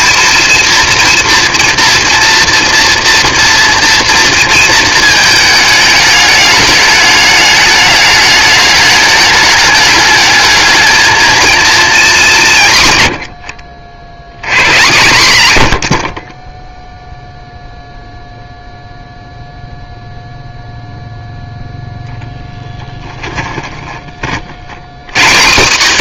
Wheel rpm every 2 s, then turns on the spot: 230, 230, 230, 210, 210, 210, 190, 90, 30, 0, 0, 10, 40.
22-24